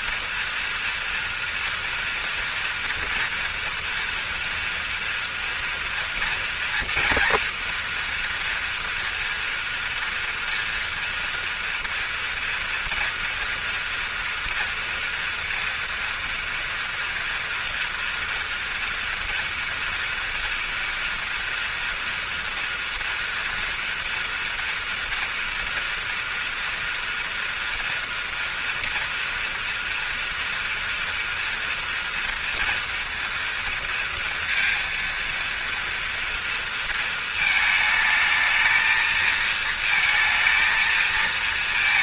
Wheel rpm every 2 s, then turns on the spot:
230, 230, 230, 230, 230, 230, 230, 230, 230, 230, 230, 230, 230, 230, 240, 230, 230, 230, 230, 220, 220.
none